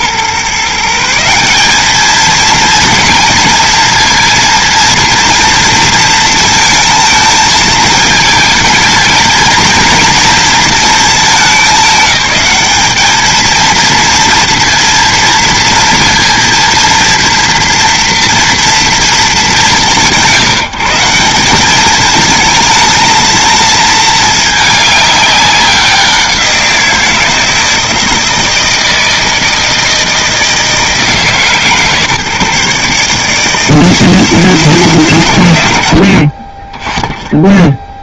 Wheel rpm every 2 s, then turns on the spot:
140, 220, 230, 230, 220, 220, 200, 230, 230, 230, 170, 220, 210, 170, 160, 160, 150, 150, 20.
none